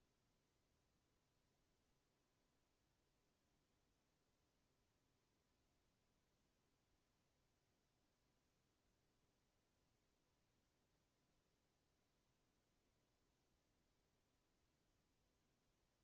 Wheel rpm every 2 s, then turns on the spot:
0, 0, 0, 0, 0, 0, 0, 0.
none